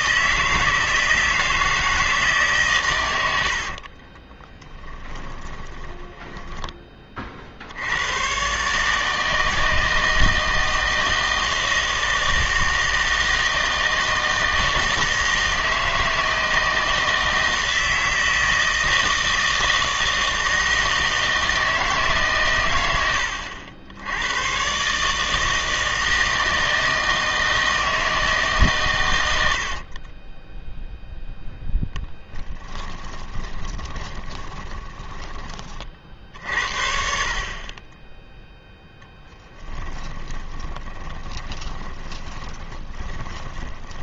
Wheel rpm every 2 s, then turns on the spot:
160, 130, 10, 10, 150, 160, 160, 160, 160, 160, 160, 110, 130, 160, 140, 0, 10, 20, 70, 0, 20, 20.
4-6 32-36 40-44